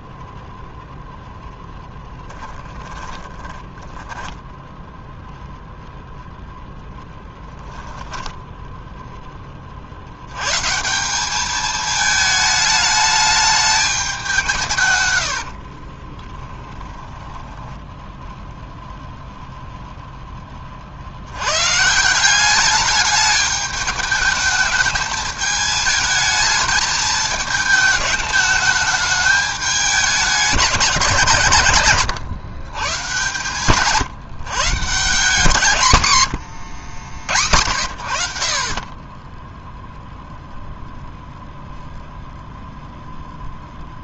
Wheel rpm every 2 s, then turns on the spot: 0, 20, 10, 10, 10, 150, 210, 140, 10, 0, 50, 210, 210, 220, 210, 190, 130, 150, 90, 30, 0, 0.
2-6 16-18 36-38